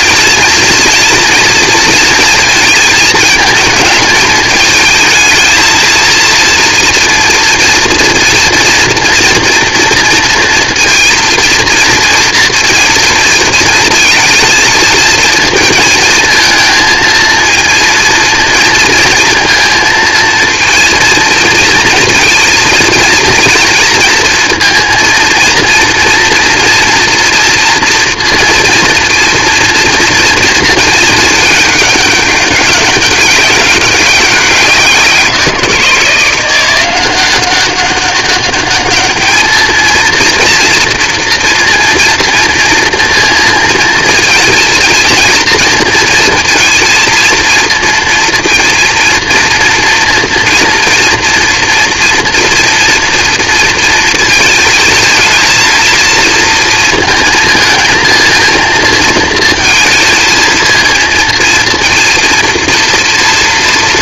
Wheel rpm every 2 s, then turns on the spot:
230, 220, 220, 230, 230, 230, 230, 220, 230, 220, 230, 220, 230, 240, 230, 210, 190, 180, 190, 220, 230, 230, 230, 230, 230, 230, 230, 230, 230, 220, 230, 230.
none